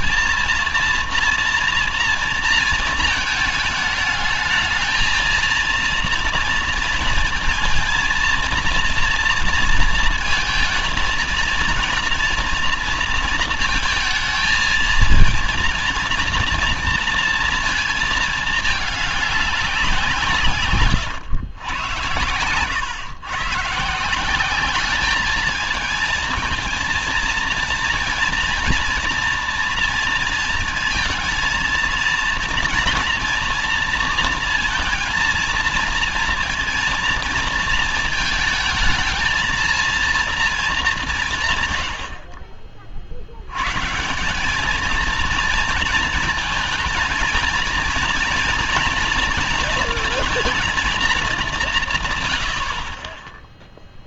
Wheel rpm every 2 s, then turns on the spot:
230, 230, 220, 230, 230, 220, 230, 220, 240, 220, 150, 110, 190, 220, 230, 230, 230, 230, 230, 220, 220, 60, 200, 220, 230, 220, 90.
none